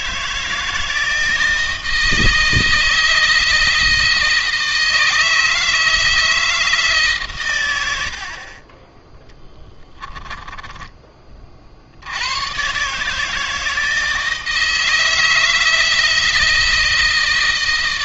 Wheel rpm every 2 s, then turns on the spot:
160, 160, 160, 160, 30, 30, 130, 160, 160.
10-12